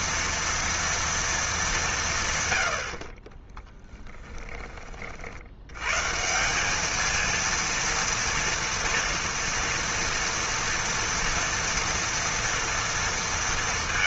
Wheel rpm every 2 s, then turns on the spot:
230, 110, 20, 180, 230, 230, 230.
4-6